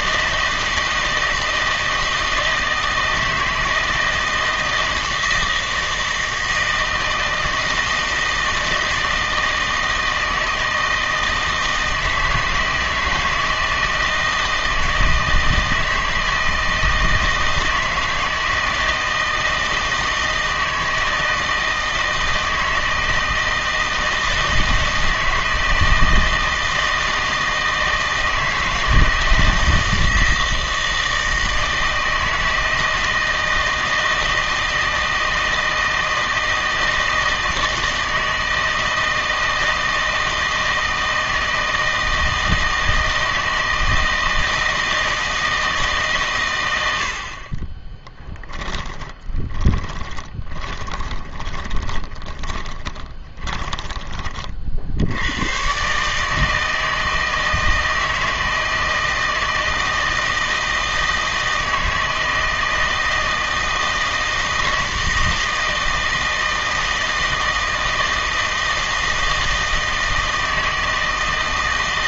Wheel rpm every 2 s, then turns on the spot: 160, 160, 160, 160, 160, 160, 160, 160, 160, 160, 160, 160, 160, 160, 160, 160, 160, 160, 160, 160, 160, 160, 160, 110, 10, 20, 20, 50, 160, 160, 160, 160, 160, 160, 160, 160.
48-54